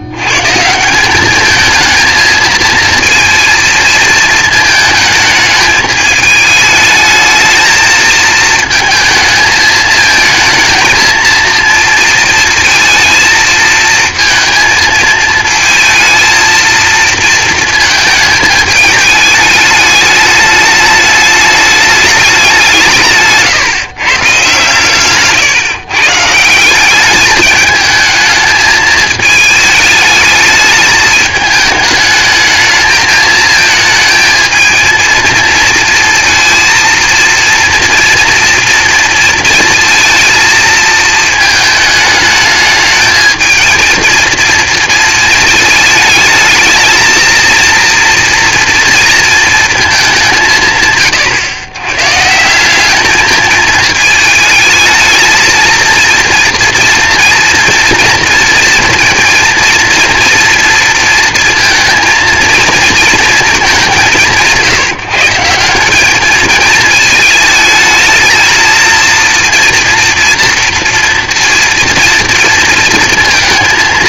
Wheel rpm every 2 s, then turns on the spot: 160, 230, 220, 210, 230, 230, 230, 230, 230, 210, 210, 180, 130, 170, 220, 210, 220, 220, 230, 230, 220, 220, 230, 220, 230, 150, 190, 220, 230, 230, 230, 230, 160, 220, 230, 230, 230.
none